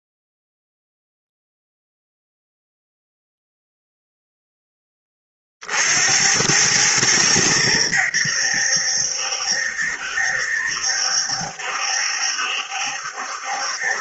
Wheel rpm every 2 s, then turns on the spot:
0, 0, 20, 100, 70, 70, 70.
none